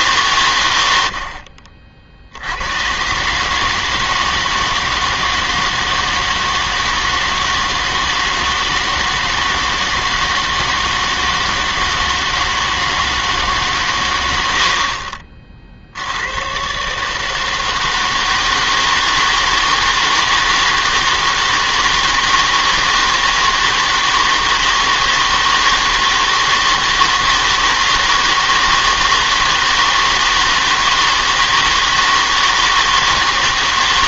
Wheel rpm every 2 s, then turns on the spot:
100, 100, 160, 160, 160, 160, 160, 70, 120, 160, 160, 160, 160, 160, 160, 160, 160.
14-16